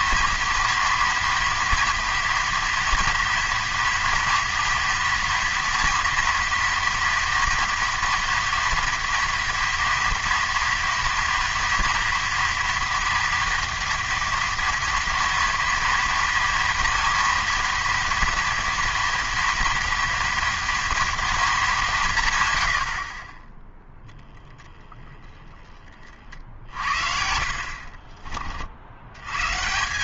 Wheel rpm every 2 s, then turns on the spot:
230, 230, 230, 230, 230, 230, 230, 230, 230, 230, 230, 100, 10, 50, 50.
22-24